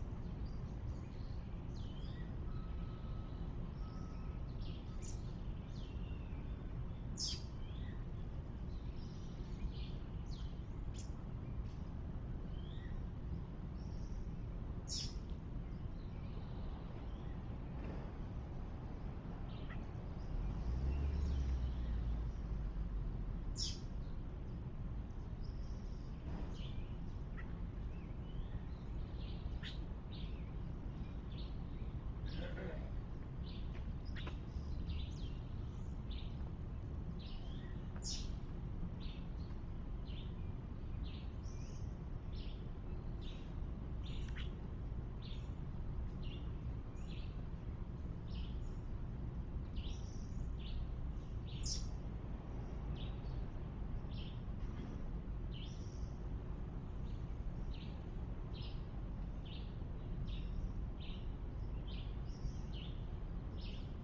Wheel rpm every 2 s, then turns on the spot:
0, 0, 0, 0, 0, 0, 0, 0, 0, 0, 0, 0, 0, 0, 0, 0, 0, 0, 0, 0, 0, 0, 0, 0, 0, 0, 0, 0, 0, 0, 0, 0.
none